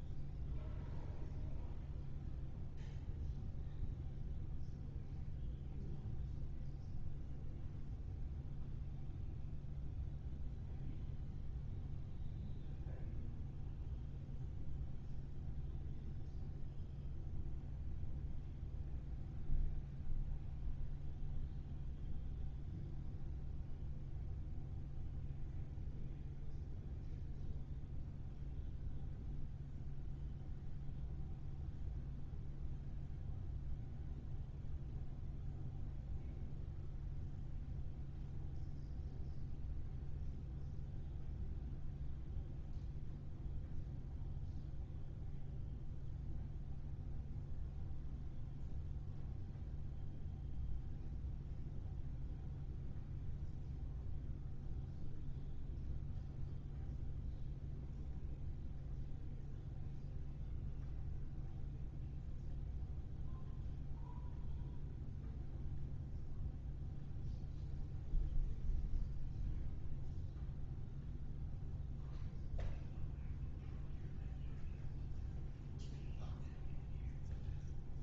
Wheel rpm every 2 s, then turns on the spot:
0, 0, 0, 0, 0, 0, 0, 0, 0, 0, 0, 0, 0, 0, 0, 0, 0, 0, 0, 0, 0, 0, 0, 0, 0, 0, 0, 0, 0, 0, 0, 0, 0, 0, 0, 0, 0, 0, 0.
none